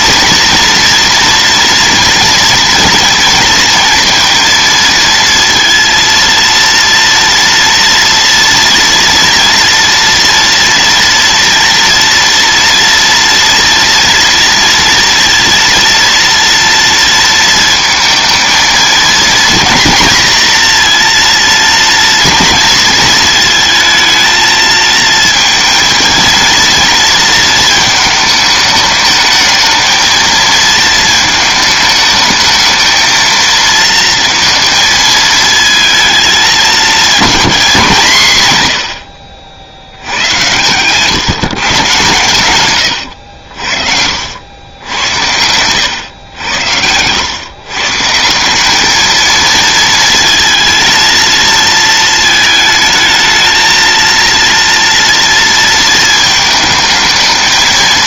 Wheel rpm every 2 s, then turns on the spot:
230, 230, 230, 230, 230, 230, 230, 230, 230, 230, 230, 230, 220, 230, 210, 220, 220, 230, 220, 80, 120, 110, 80, 100, 210, 220, 220, 230, 220.
none